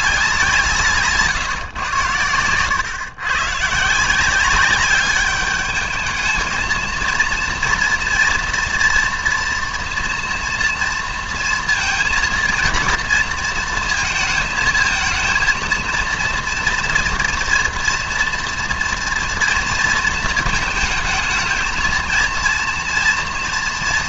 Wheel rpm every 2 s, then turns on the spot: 170, 120, 190, 230, 240, 240, 230, 220, 230, 240, 220, 230.
none